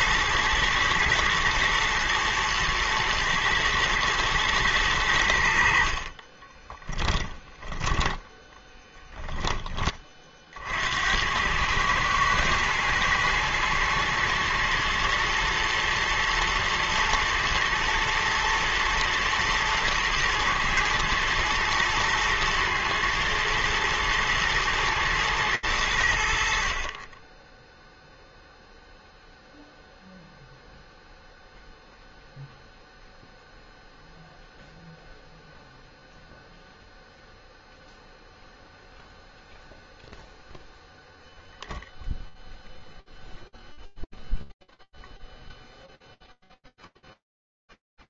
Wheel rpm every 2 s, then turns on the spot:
110, 110, 100, 10, 10, 80, 110, 110, 110, 120, 110, 110, 110, 30, 0, 0, 0, 0, 0, 0, 0, 0, 0, 0.
6-8